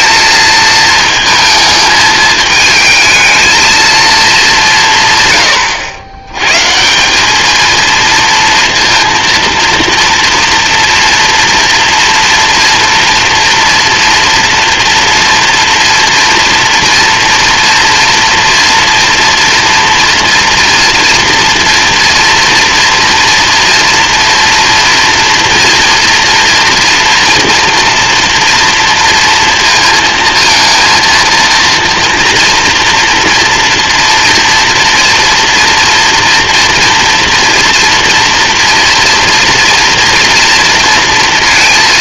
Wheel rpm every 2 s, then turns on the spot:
220, 220, 140, 190, 230, 230, 240, 230, 240, 230, 230, 230, 230, 240, 230, 230, 230, 230, 230, 240, 230.
none